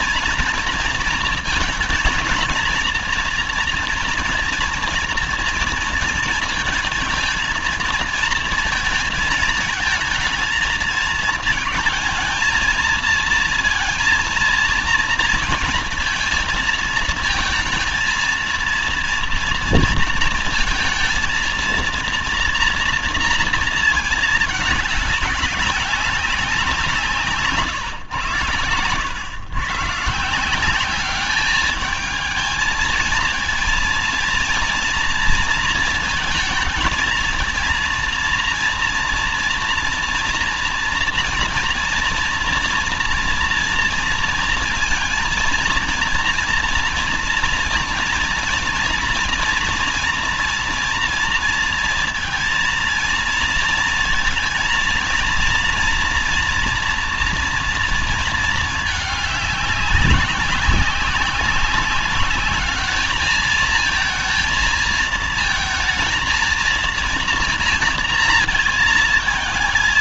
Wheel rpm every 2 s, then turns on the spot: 230, 230, 230, 220, 230, 220, 230, 230, 230, 230, 230, 230, 210, 190, 120, 180, 220, 230, 220, 230, 230, 230, 230, 230, 230, 230, 220, 230, 230, 230, 200, 210, 230, 230, 220.
28-30